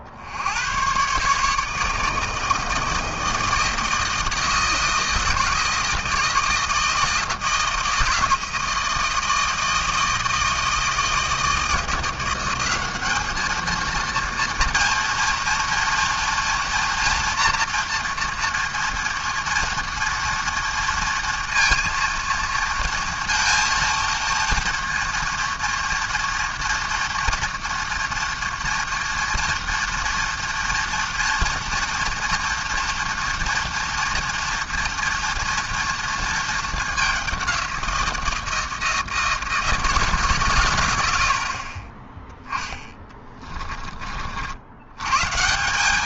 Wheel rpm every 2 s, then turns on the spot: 100, 160, 160, 160, 160, 160, 190, 230, 230, 230, 230, 230, 230, 230, 230, 230, 230, 230, 210, 160, 110, 20, 80.
42-44